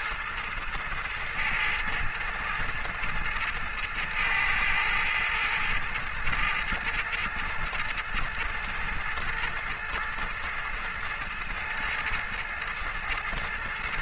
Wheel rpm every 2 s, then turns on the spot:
110, 110, 110, 110, 110, 110, 110.
none